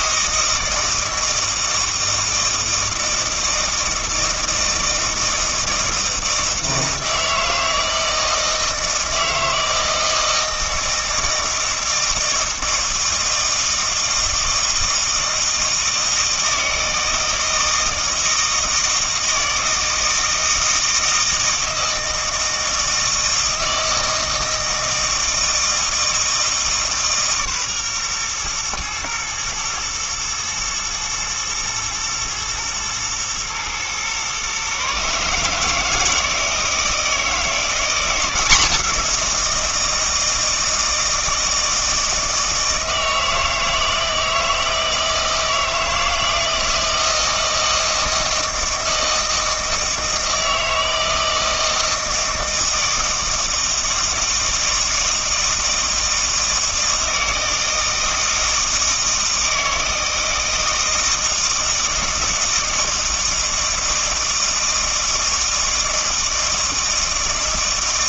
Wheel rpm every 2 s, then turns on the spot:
160, 160, 160, 160, 160, 160, 160, 160, 160, 160, 160, 160, 160, 150, 120, 120, 120, 140, 160, 180, 160, 160, 160, 160, 160, 160, 160, 160, 160, 160, 160, 160, 160, 160.
none